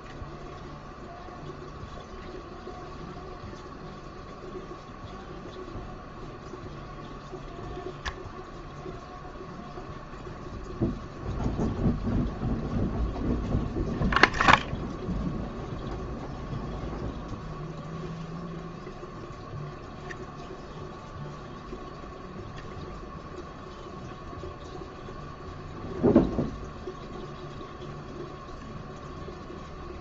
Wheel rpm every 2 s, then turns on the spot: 0, 0, 0, 0, 0, 0, 0, 0, 0, 0, 0, 0, 0, 0, 0.
none